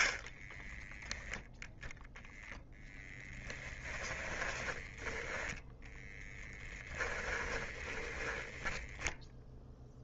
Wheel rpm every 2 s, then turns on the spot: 10, 0, 10, 10, 10.
0-2 4-10